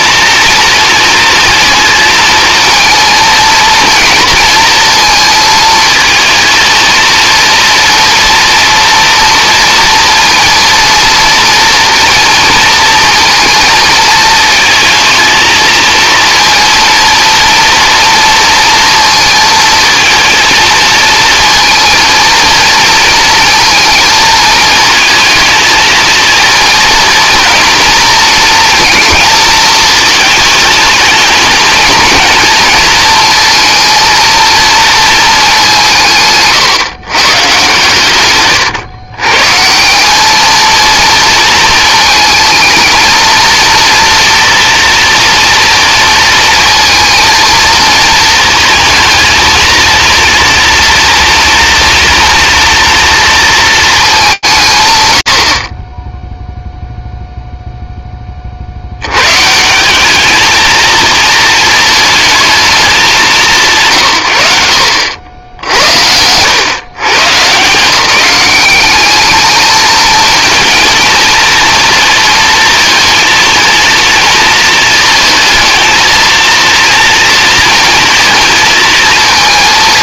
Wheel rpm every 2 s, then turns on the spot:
230, 230, 220, 230, 230, 230, 230, 230, 230, 230, 220, 230, 220, 230, 230, 220, 230, 230, 150, 120, 220, 220, 230, 230, 230, 230, 230, 160, 0, 70, 220, 220, 80, 120, 190, 230, 230, 220, 230, 230.
64-66